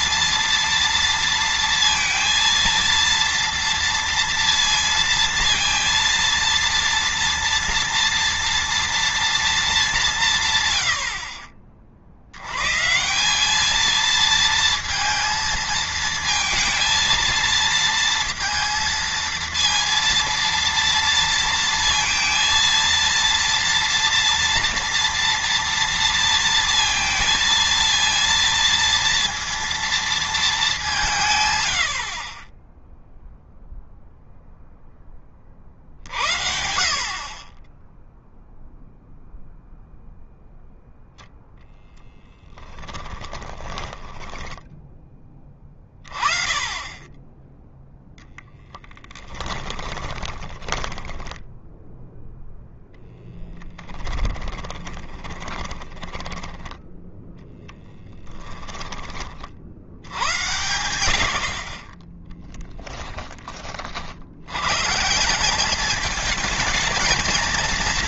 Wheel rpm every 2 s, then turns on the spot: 230, 230, 230, 230, 230, 100, 150, 230, 230, 230, 230, 230, 230, 230, 230, 200, 10, 10, 40, 0, 0, 20, 10, 20, 10, 10, 0, 20, 10, 20, 80, 10, 140, 220.
42-44 48-52 54-56